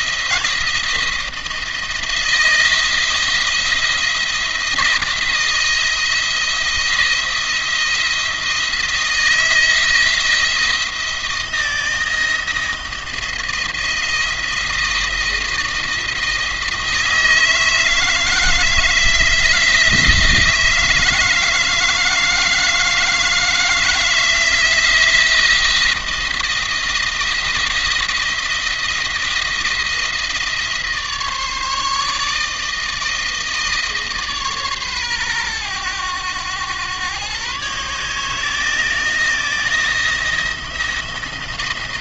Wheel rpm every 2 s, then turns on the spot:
170, 170, 170, 170, 170, 170, 160, 170, 160, 160, 160, 160, 170, 170, 170, 160, 160, 140, 110, 160, 170.
none